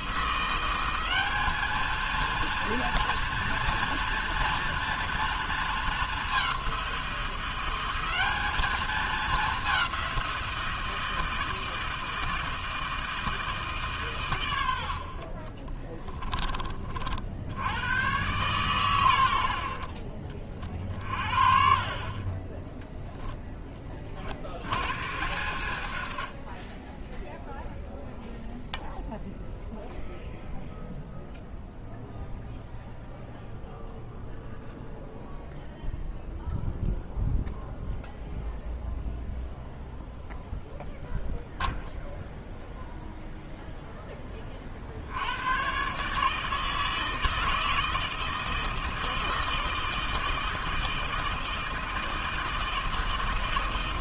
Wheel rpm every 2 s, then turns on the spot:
190, 230, 230, 180, 210, 170, 160, 70, 40, 120, 40, 10, 110, 10, 0, 0, 0, 0, 0, 0, 0, 0, 50, 160, 160, 160, 160.
none